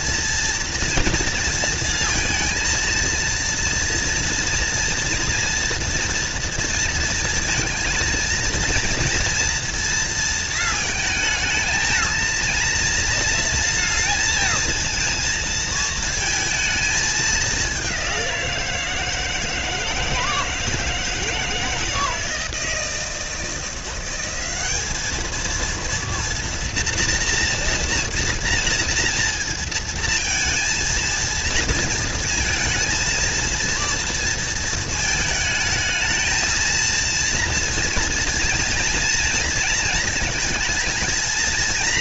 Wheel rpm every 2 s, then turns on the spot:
230, 230, 230, 230, 230, 230, 230, 230, 220, 170, 160, 160, 200, 230, 230, 220, 220, 220, 230, 230, 230.
none